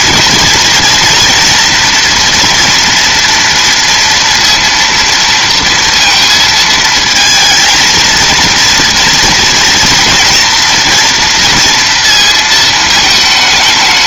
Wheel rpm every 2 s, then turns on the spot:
230, 230, 230, 220, 230, 230, 220.
none